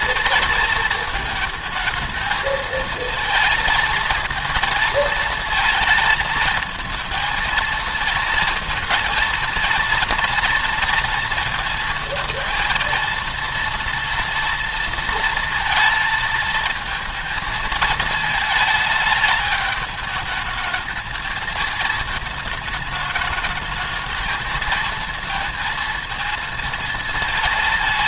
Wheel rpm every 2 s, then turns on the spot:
230, 220, 230, 220, 230, 230, 230, 230, 230, 220, 210, 220, 220, 230.
none